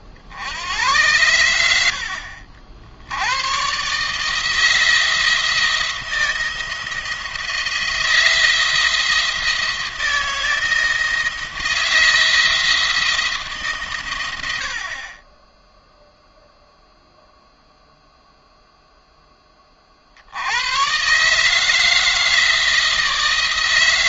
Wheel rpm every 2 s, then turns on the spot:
90, 60, 160, 160, 170, 170, 170, 70, 0, 0, 110, 160.
none